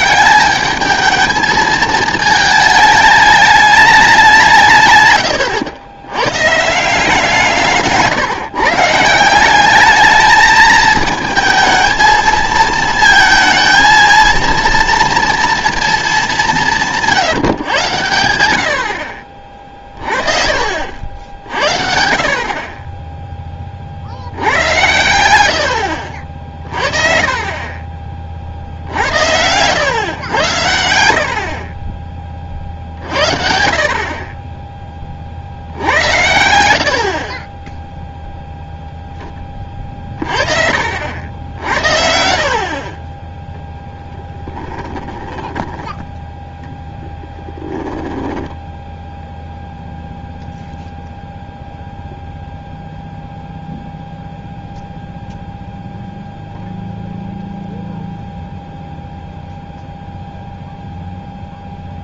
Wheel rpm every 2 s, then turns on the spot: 200, 220, 160, 140, 140, 220, 220, 230, 180, 70, 50, 40, 90, 40, 50, 90, 40, 20, 90, 0, 50, 50, 10, 10, 10, 0, 0, 0, 0, 0, 0.
44-46 48-50